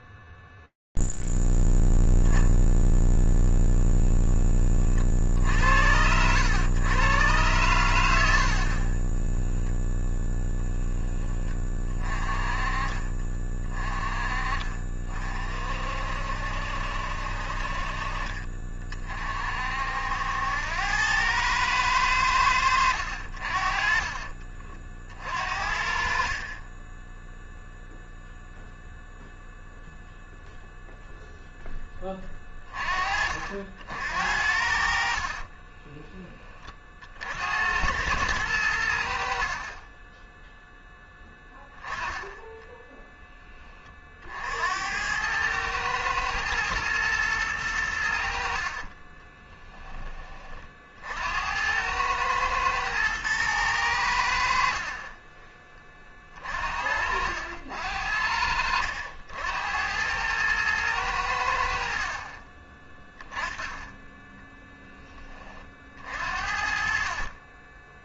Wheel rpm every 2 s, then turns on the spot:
0, 0, 10, 80, 80, 0, 20, 30, 60, 40, 80, 90, 40, 40, 0, 0, 30, 60, 30, 80, 0, 10, 70, 110, 50, 40, 110, 60, 40, 70, 110, 20, 10, 50.
34-36 48-50